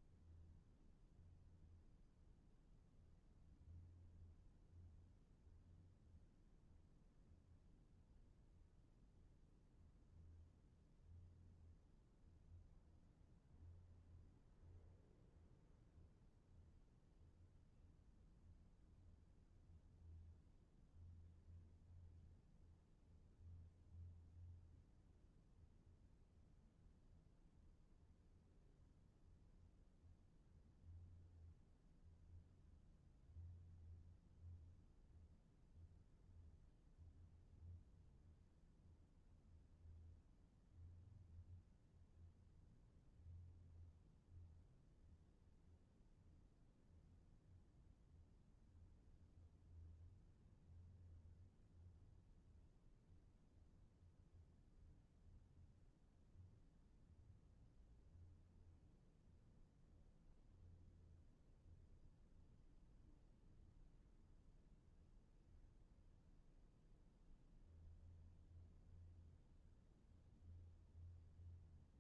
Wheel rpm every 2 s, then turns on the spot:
0, 0, 0, 0, 0, 0, 0, 0, 0, 0, 0, 0, 0, 0, 0, 0, 0, 0, 0, 0, 0, 0, 0, 0, 0, 0, 0, 0, 0, 0, 0, 0, 0, 0, 0, 0.
none